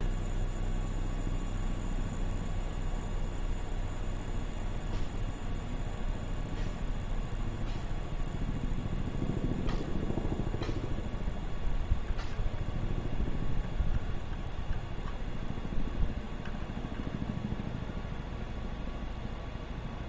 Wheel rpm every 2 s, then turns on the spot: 0, 0, 0, 0, 0, 0, 0, 0, 0, 0.
none